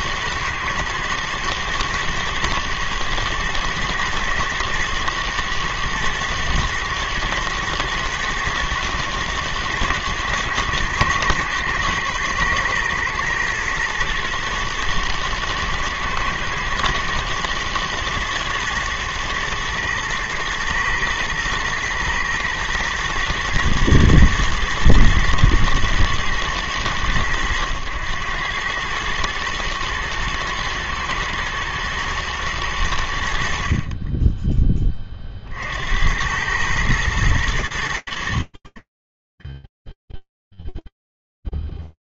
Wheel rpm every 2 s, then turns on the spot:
110, 110, 110, 120, 110, 110, 110, 120, 110, 110, 110, 120, 110, 110, 100, 110, 110, 10, 100, 40, 0.
none